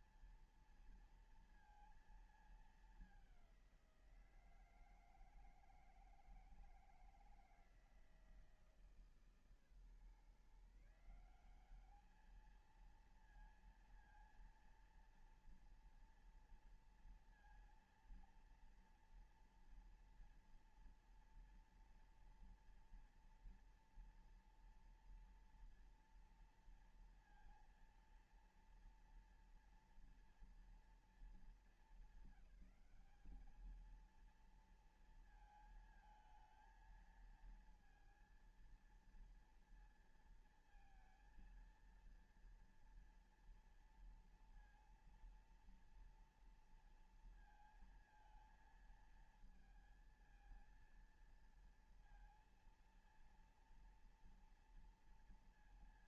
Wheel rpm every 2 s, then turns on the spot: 230, 220, 170, 160, 160, 140, 210, 230, 230, 230, 240, 240, 240, 230, 230, 240, 200, 230, 220, 230, 230, 230, 230, 230, 220, 230, 230, 230.
none